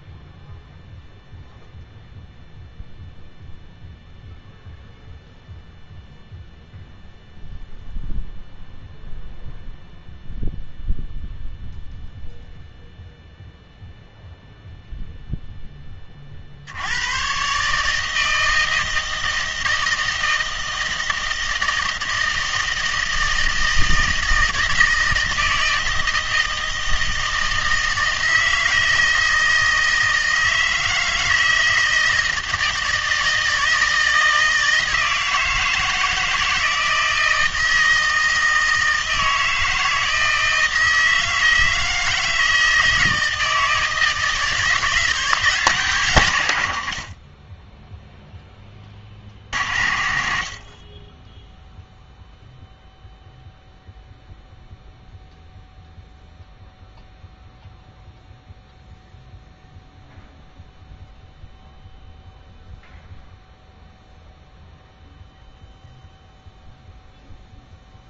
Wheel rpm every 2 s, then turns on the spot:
0, 0, 0, 0, 0, 0, 0, 0, 70, 160, 160, 160, 160, 160, 160, 160, 160, 160, 160, 160, 160, 160, 160, 110, 10, 50, 0, 0, 0, 0, 0, 0, 0, 0.
none